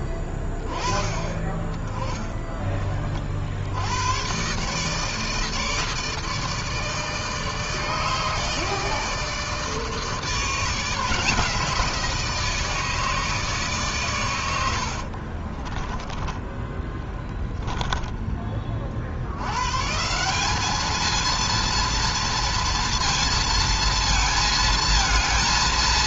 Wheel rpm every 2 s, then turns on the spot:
20, 20, 140, 160, 160, 160, 160, 90, 10, 30, 200, 230, 220.
14-18